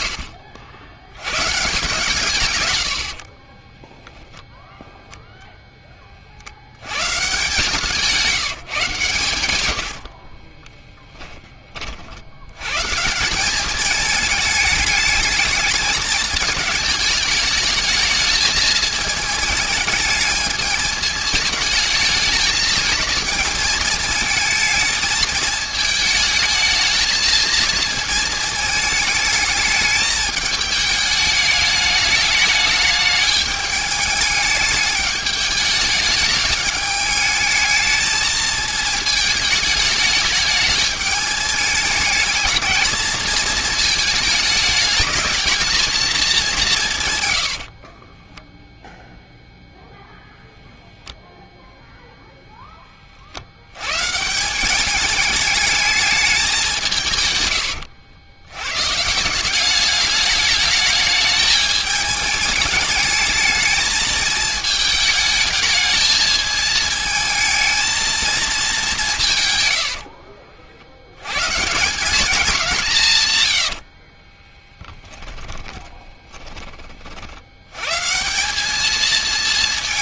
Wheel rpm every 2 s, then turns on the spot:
70, 120, 0, 60, 160, 30, 120, 220, 210, 220, 220, 220, 220, 220, 220, 210, 210, 210, 210, 220, 210, 220, 210, 180, 10, 0, 0, 180, 190, 110, 210, 210, 220, 220, 210, 60, 190, 10, 20, 200.
10-12 74-76